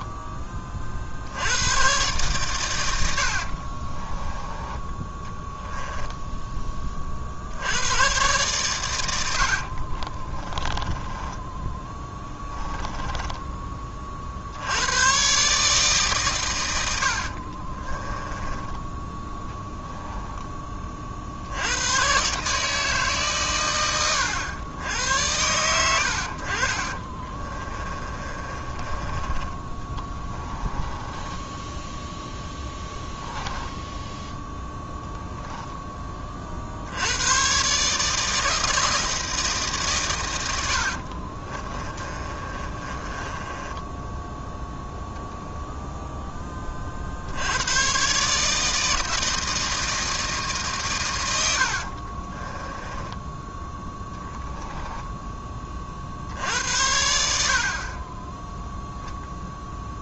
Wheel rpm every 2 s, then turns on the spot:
40, 120, 10, 20, 130, 20, 10, 90, 110, 10, 20, 150, 90, 50, 30, 10, 10, 0, 60, 160, 70, 30, 0, 30, 160, 150, 20, 10, 80, 0.
10-14 18-20 28-34 40-44 52-56